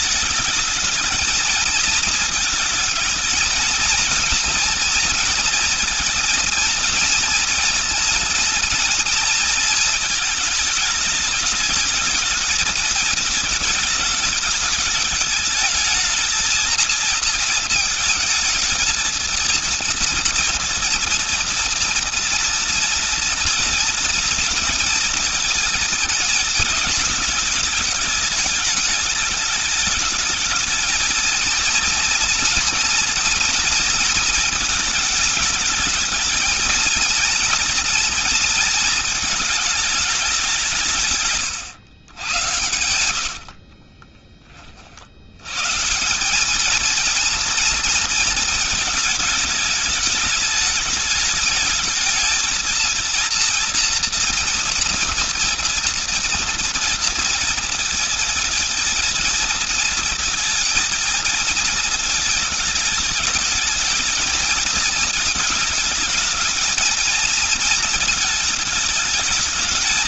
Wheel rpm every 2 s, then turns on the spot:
210, 220, 230, 230, 240, 220, 220, 210, 220, 220, 230, 230, 230, 220, 210, 220, 240, 220, 230, 230, 180, 90, 40, 220, 220, 210, 220, 240, 230, 230, 220, 220, 220, 220, 220.
42-44